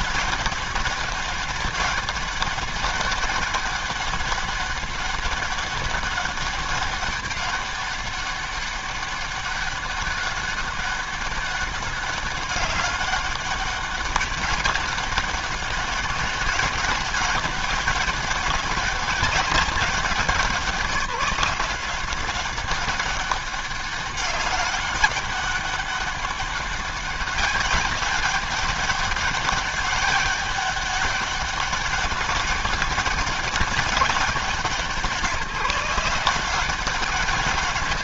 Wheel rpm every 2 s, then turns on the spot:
200, 200, 200, 200, 200, 200, 200, 200, 200, 200, 180, 200, 200, 200, 200, 200, 200, 160, 180.
none